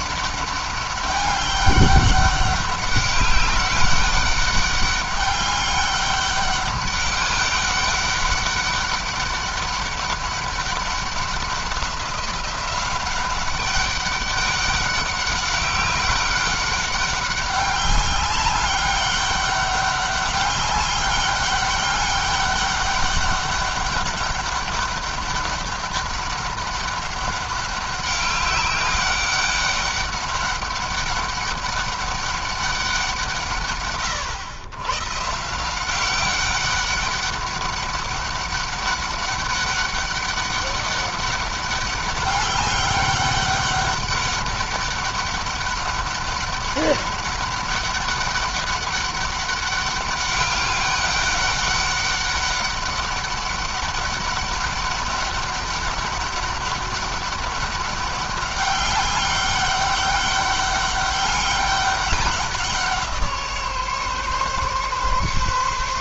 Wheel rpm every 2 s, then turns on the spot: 200, 200, 200, 200, 200, 200, 190, 200, 200, 200, 200, 200, 200, 200, 200, 200, 190, 120, 200, 200, 200, 200, 200, 200, 200, 200, 200, 200, 200, 200, 200, 180, 140.
none